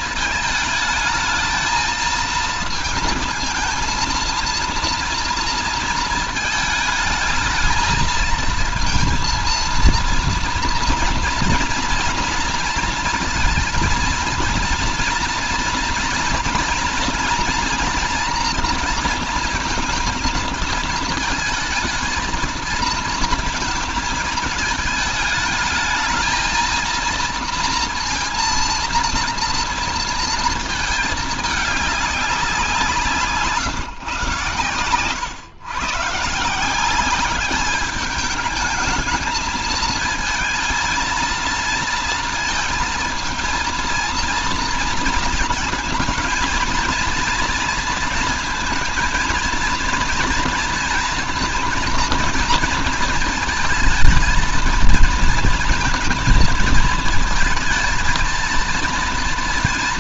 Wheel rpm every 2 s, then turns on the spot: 220, 220, 230, 220, 230, 230, 230, 230, 230, 230, 220, 230, 220, 230, 230, 220, 180, 110, 160, 210, 230, 230, 230, 230, 230, 230, 230, 220, 230, 230.
none